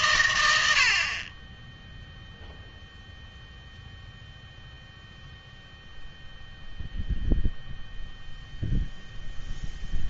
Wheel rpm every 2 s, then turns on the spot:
80, 0, 0, 0, 0.
none